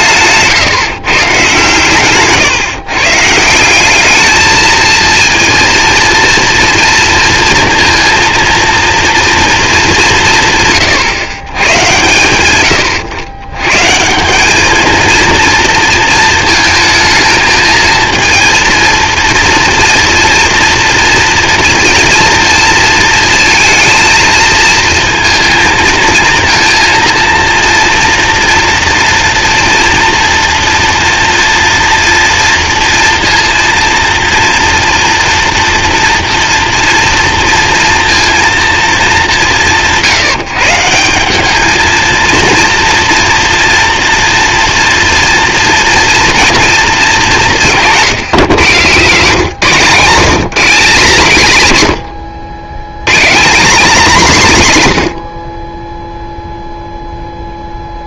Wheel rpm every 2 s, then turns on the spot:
150, 140, 220, 230, 230, 140, 110, 200, 230, 230, 230, 230, 230, 230, 230, 230, 230, 230, 230, 230, 160, 230, 240, 230, 160, 180, 100, 180, 0.
none